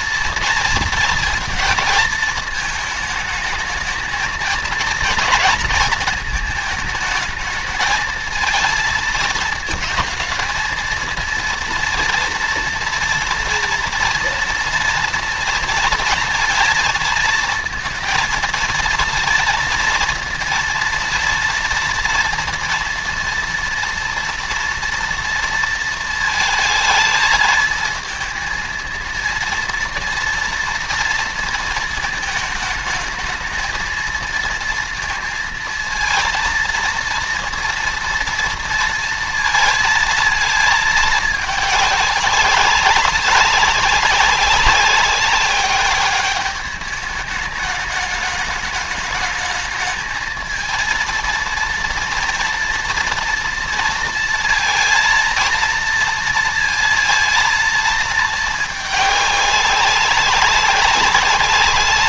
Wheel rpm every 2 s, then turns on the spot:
230, 220, 230, 220, 230, 230, 230, 230, 230, 230, 230, 230, 240, 220, 230, 230, 220, 230, 230, 230, 220, 200, 200, 200, 200, 230, 230, 230, 230, 210, 200.
none